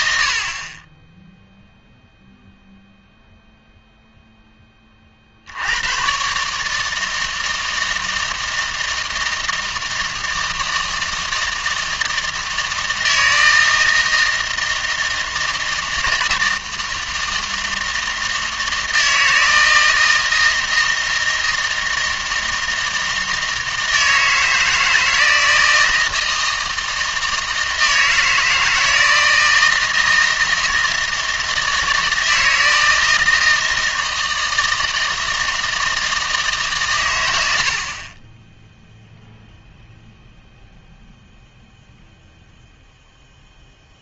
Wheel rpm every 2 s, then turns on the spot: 30, 0, 20, 150, 160, 160, 160, 160, 160, 160, 160, 160, 160, 160, 160, 160, 160, 160, 140, 10, 0, 0.
none